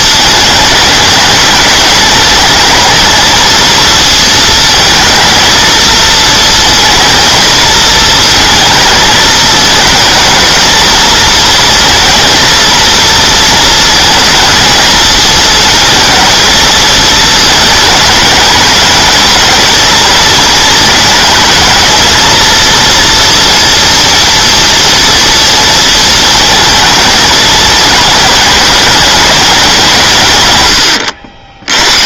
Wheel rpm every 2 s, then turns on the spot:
210, 220, 220, 230, 220, 220, 230, 220, 220, 210, 230, 230, 230, 220, 210, 100.
none